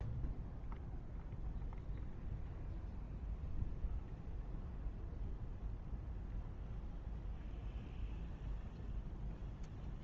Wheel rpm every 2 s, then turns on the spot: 0, 0, 0, 0, 0.
none